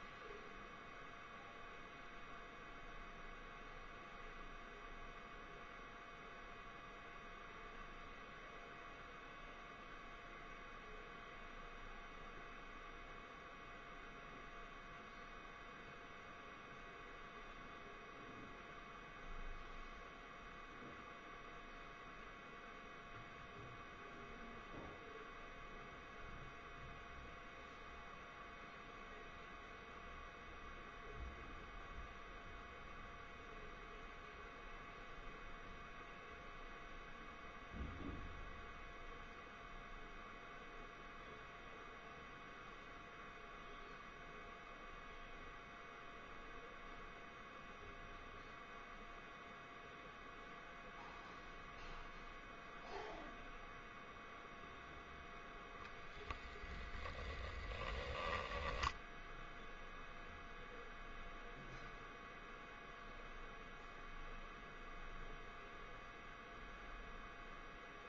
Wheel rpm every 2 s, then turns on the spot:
0, 0, 0, 0, 0, 0, 0, 0, 0, 0, 0, 0, 0, 0, 0, 0, 0, 0, 0, 0, 0, 0, 0, 0, 0, 0, 0, 0, 10, 0, 0, 0, 0, 0.
none